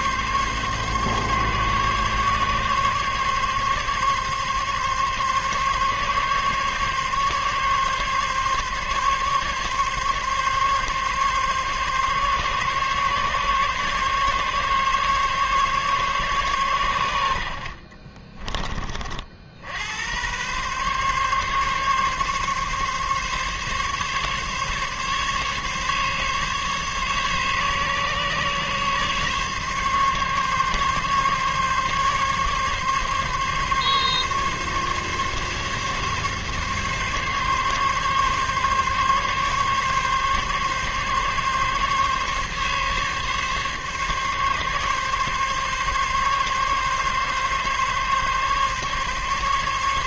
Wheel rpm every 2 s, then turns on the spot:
140, 140, 140, 140, 140, 140, 140, 140, 130, 30, 120, 140, 140, 140, 140, 140, 140, 140, 140, 140, 140, 140, 140, 140, 140.
none